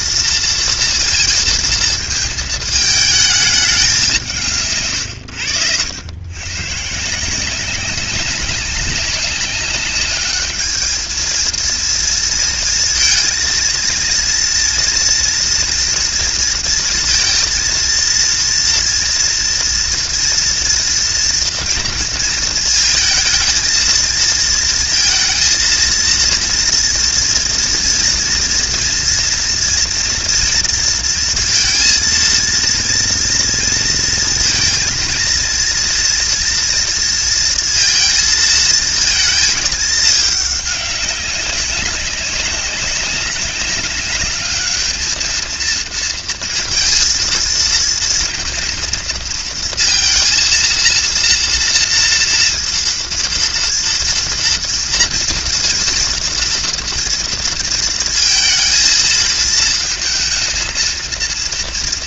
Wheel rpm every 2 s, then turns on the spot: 230, 220, 140, 130, 200, 220, 230, 240, 230, 230, 230, 220, 230, 230, 230, 230, 230, 230, 230, 230, 200, 190, 210, 230, 230, 230, 230, 230, 230, 220, 230.
none